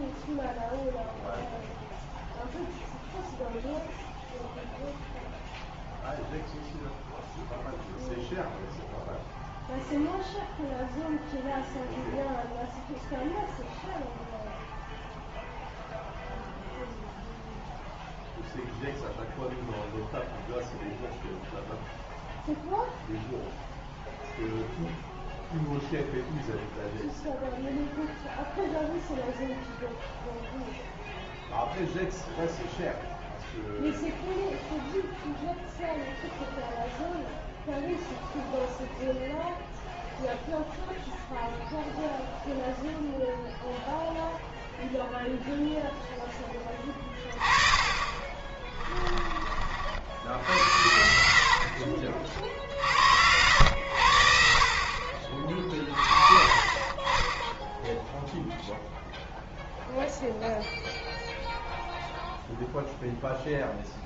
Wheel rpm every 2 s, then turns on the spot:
0, 0, 0, 0, 0, 0, 0, 0, 0, 0, 0, 0, 0, 0, 0, 0, 0, 0, 0, 0, 0, 0, 0, 10, 30, 80, 50, 50, 40, 0, 0, 0.
48-50